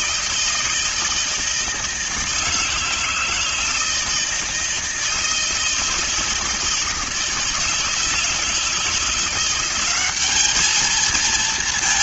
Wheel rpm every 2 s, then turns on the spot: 160, 160, 160, 160, 170, 220.
none